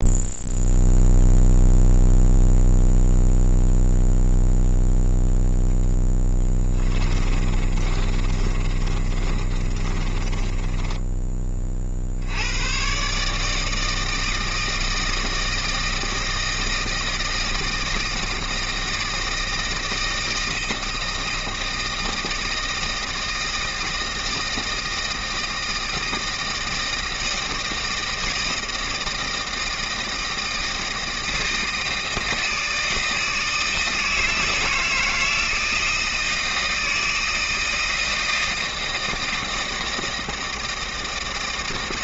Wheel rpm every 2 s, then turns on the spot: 0, 0, 0, 20, 30, 20, 110, 160, 160, 160, 160, 160, 160, 160, 160, 160, 160, 160, 160, 160, 160.
6-12